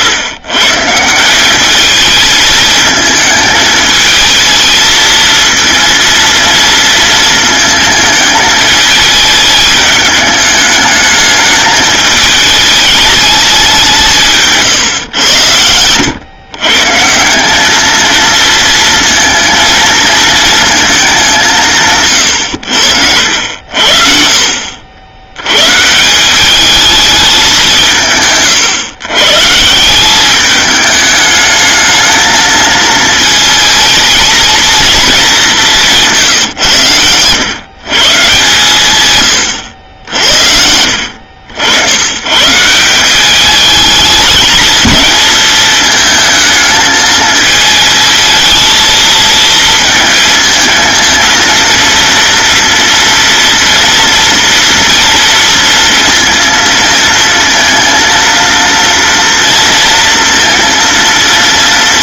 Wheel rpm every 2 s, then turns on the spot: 130, 220, 230, 230, 220, 210, 210, 150, 130, 230, 220, 100, 60, 200, 140, 210, 230, 230, 130, 140, 70, 160, 220, 220, 220, 220, 230, 230, 230, 230, 230.
none